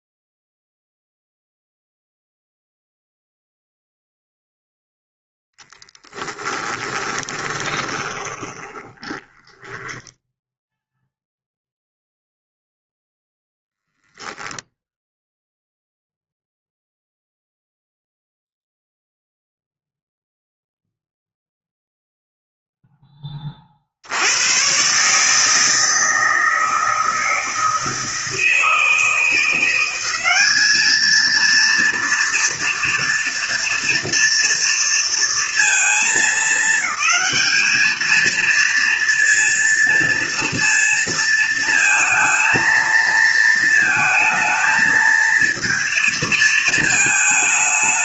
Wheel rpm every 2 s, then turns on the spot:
0, 0, 0, 10, 40, 0, 0, 0, 0, 0, 0, 10, 130, 160, 160, 220, 230, 230, 210, 230, 230, 230, 220, 220.
6-10